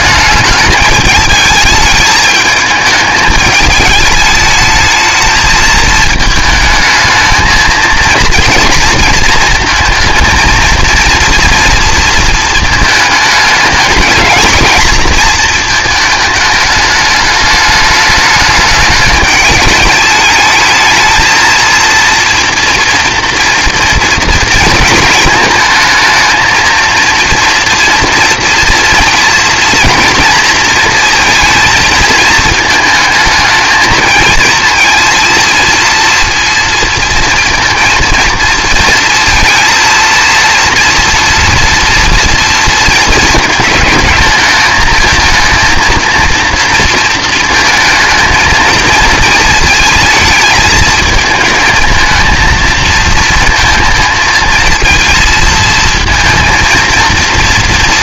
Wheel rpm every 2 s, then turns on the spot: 210, 220, 220, 220, 230, 230, 220, 220, 210, 210, 220, 230, 230, 230, 230, 230, 220, 230, 230, 230, 230, 230, 220, 230, 220, 220, 230, 230, 230.
none